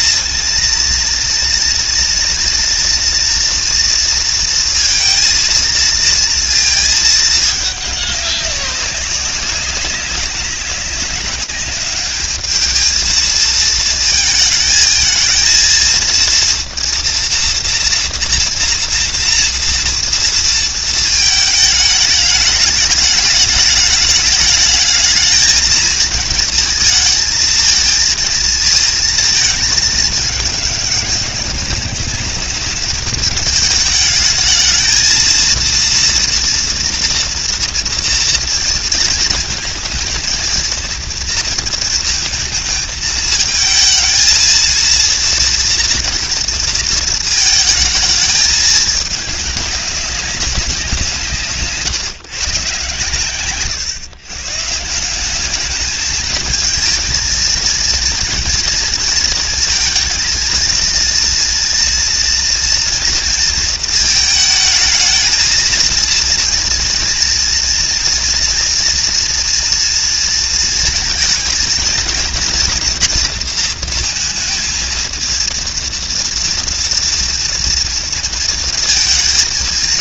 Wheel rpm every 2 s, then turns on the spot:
230, 230, 230, 220, 200, 200, 220, 220, 230, 230, 220, 220, 220, 220, 220, 200, 210, 220, 240, 230, 230, 220, 230, 230, 210, 180, 120, 170, 220, 230, 230, 230, 220, 230, 230, 230, 230, 230, 230, 230.
none